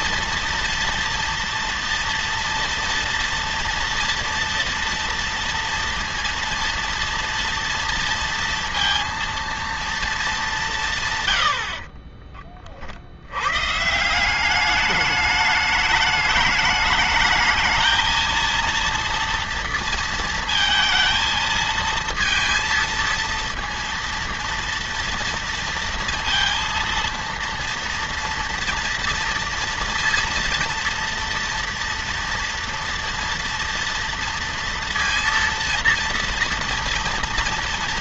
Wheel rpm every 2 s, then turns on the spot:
230, 230, 230, 230, 230, 210, 40, 160, 210, 220, 230, 230, 230, 230, 230, 230, 230, 230, 230.
12-14